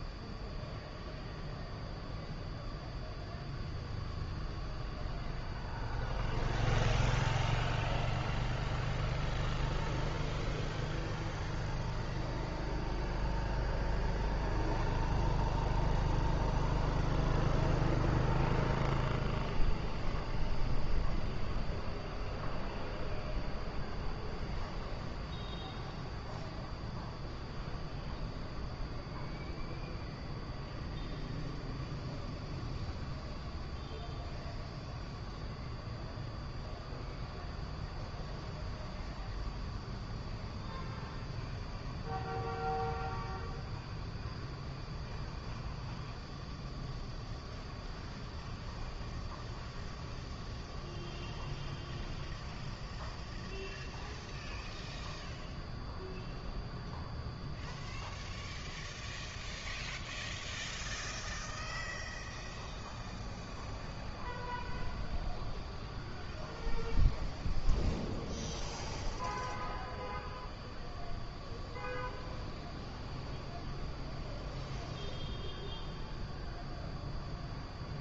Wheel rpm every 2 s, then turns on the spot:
0, 0, 0, 0, 0, 0, 0, 0, 0, 0, 0, 0, 0, 0, 0, 0, 0, 0, 0, 0, 0, 0, 0, 0, 0, 0, 0, 0, 0, 0, 0, 0, 0, 0, 0, 0, 0, 0, 0.
none